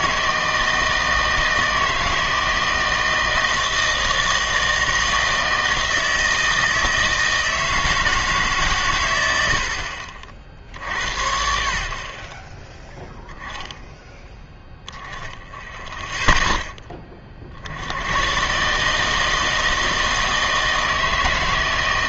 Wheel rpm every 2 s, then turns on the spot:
160, 160, 160, 160, 130, 70, 20, 10, 10, 140, 160.
none